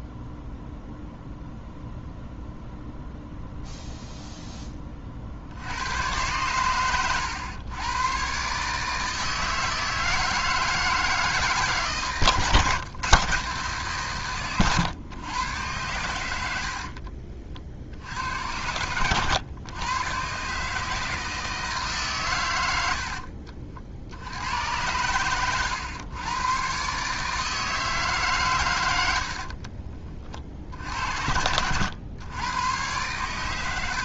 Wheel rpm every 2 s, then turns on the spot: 0, 0, 20, 110, 140, 160, 140, 120, 80, 100, 140, 100, 100, 120, 120, 50, 110.
16-18